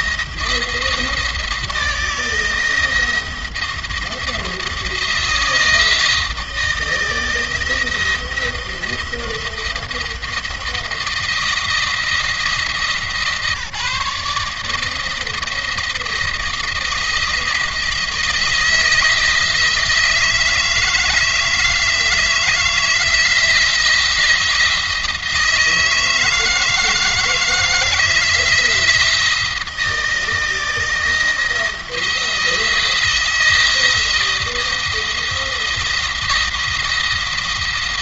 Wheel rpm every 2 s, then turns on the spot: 160, 170, 160, 160, 170, 160, 160, 160, 170, 160, 160, 160, 160, 160, 160, 170, 170, 170, 170.
none